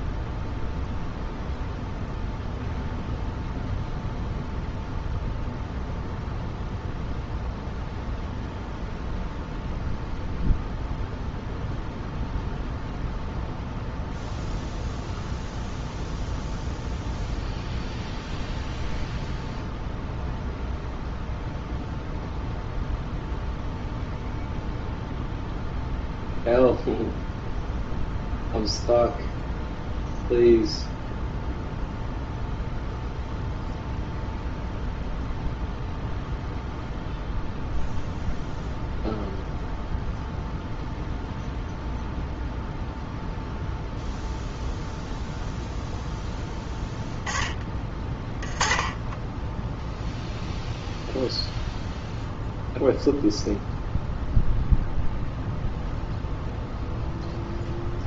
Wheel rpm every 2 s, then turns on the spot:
0, 0, 0, 0, 0, 0, 0, 0, 0, 0, 0, 0, 0, 0, 0, 0, 0, 0, 0, 0, 0, 0, 0, 10, 10, 0, 0, 0, 0.
none